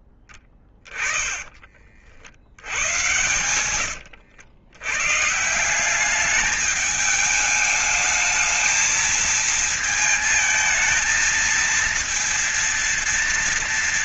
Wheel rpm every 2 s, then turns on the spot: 10, 70, 90, 200, 220, 220, 230.
0-2